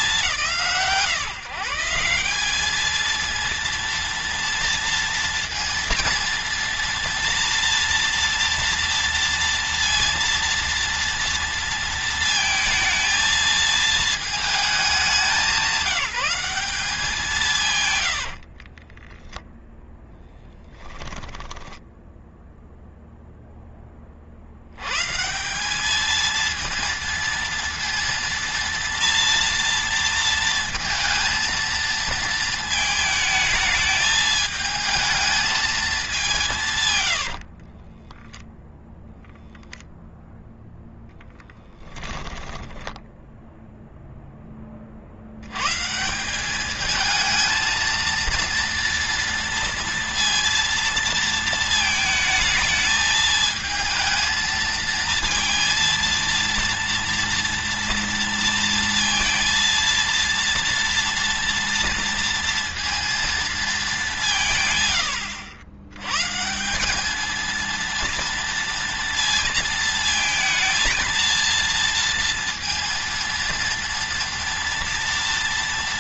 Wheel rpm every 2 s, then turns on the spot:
160, 220, 230, 230, 230, 230, 220, 210, 190, 30, 10, 0, 120, 230, 230, 230, 220, 220, 110, 0, 0, 10, 40, 220, 230, 230, 220, 230, 230, 230, 230, 230, 120, 200, 230, 230, 230, 230.
18-22 36-38 42-44